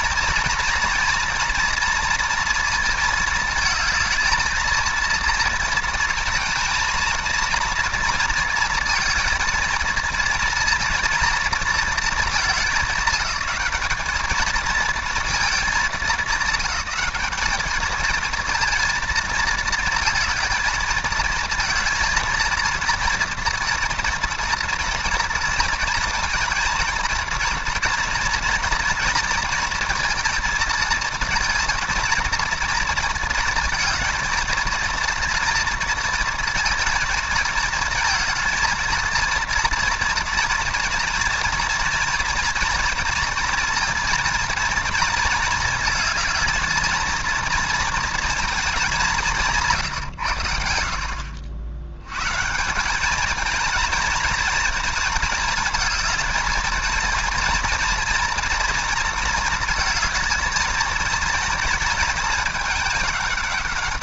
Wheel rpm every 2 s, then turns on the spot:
230, 230, 230, 220, 230, 230, 200, 220, 200, 230, 220, 230, 230, 220, 230, 230, 230, 230, 230, 230, 240, 230, 220, 220, 200, 80, 170, 230, 230, 230, 220, 210.
none